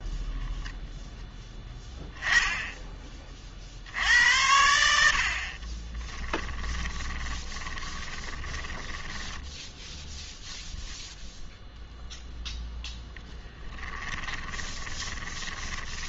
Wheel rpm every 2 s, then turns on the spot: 0, 10, 80, 10, 20, 0, 0, 20.
6-10 14-16